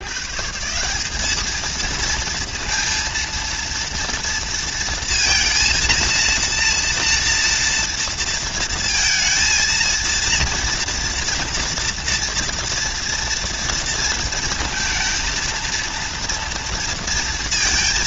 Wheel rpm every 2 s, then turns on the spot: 160, 230, 230, 230, 230, 230, 230, 230, 230.
none